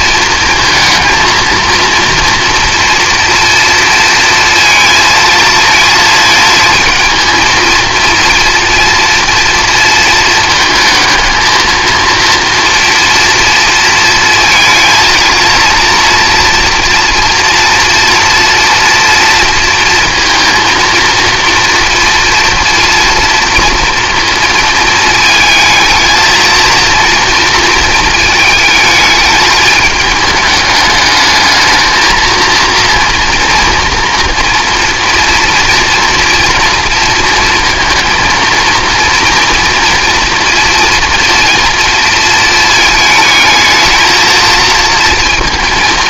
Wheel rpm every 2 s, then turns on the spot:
230, 230, 230, 220, 230, 220, 240, 230, 240, 230, 230, 230, 220, 230, 220, 210, 230, 240, 230, 230, 240, 220, 230.
none